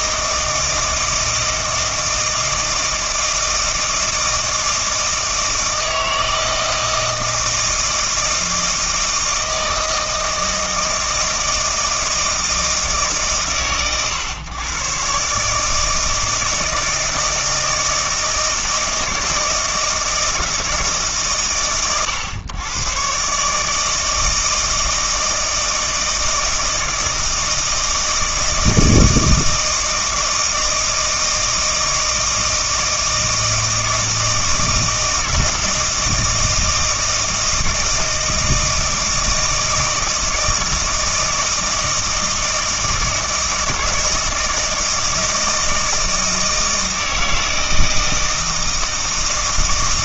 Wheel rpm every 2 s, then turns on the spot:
160, 160, 160, 160, 160, 160, 160, 120, 160, 160, 160, 120, 160, 160, 160, 160, 160, 160, 160, 160, 160, 160, 160, 160, 160.
none